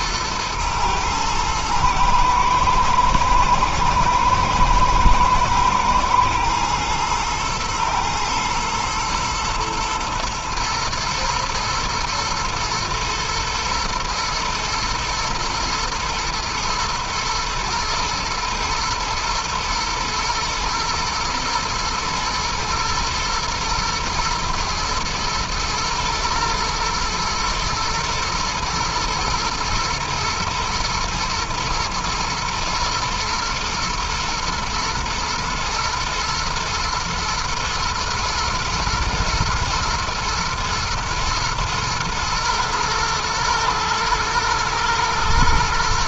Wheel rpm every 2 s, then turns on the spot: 110, 110, 110, 110, 110, 110, 110, 110, 110, 110, 110, 120, 120, 110, 110, 120, 110, 110, 110, 110, 110, 120, 110.
none